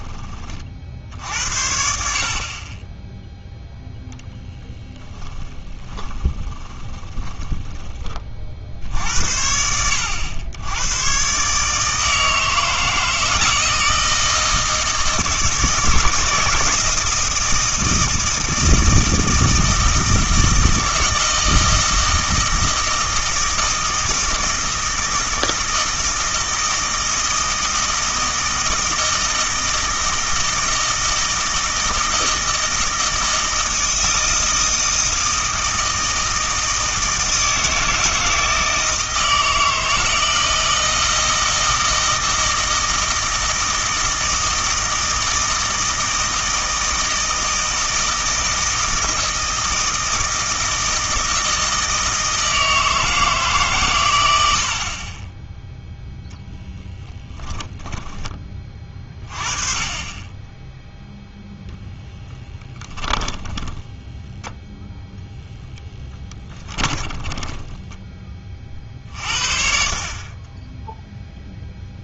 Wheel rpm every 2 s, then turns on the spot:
50, 30, 0, 10, 60, 100, 160, 160, 160, 160, 160, 160, 160, 160, 160, 160, 160, 160, 160, 160, 160, 160, 160, 160, 160, 160, 160, 70, 0, 20, 10, 20, 0, 20, 40, 10.
6-8 62-64 66-68